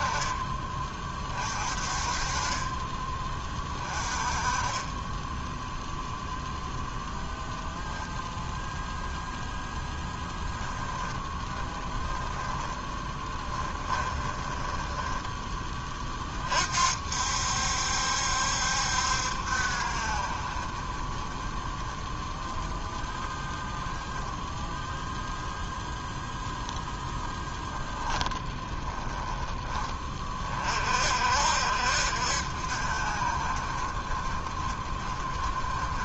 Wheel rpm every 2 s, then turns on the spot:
30, 20, 20, 0, 10, 20, 10, 10, 60, 70, 30, 10, 0, 10, 20, 50, 50, 30.
10-16